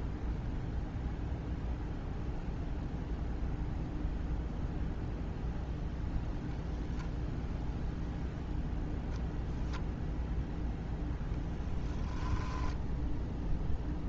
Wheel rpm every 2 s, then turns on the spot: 0, 0, 0, 0, 0, 0, 10.
none